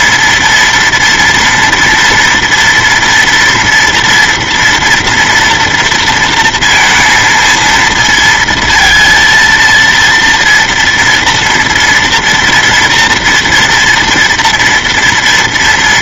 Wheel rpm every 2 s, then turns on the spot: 230, 230, 240, 230, 230, 230, 230, 230.
none